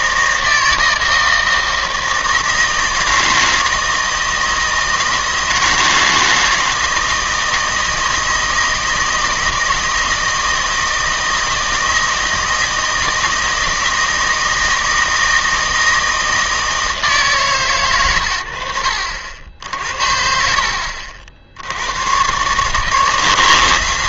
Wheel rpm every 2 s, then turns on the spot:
160, 160, 160, 160, 160, 160, 160, 160, 160, 70, 60, 140.
none